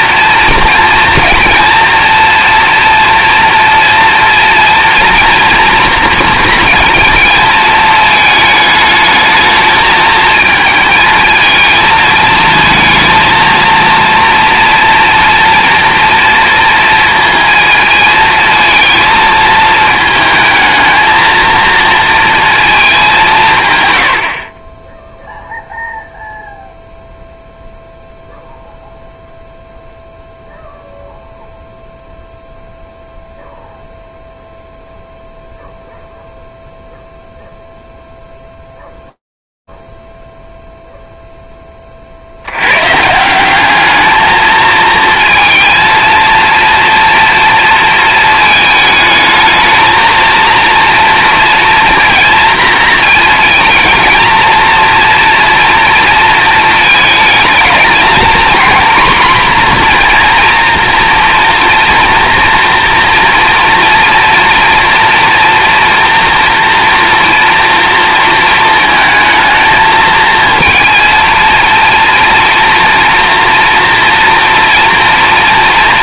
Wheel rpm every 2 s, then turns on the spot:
230, 230, 230, 230, 210, 220, 230, 230, 230, 230, 220, 230, 40, 0, 0, 0, 0, 0, 0, 0, 0, 170, 230, 230, 220, 230, 220, 230, 210, 240, 230, 240, 240, 230, 220, 230, 230, 230.
none